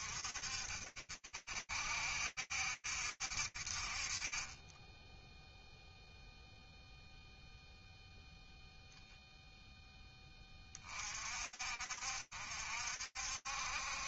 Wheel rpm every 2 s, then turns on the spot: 60, 70, 10, 0, 0, 50, 70.
none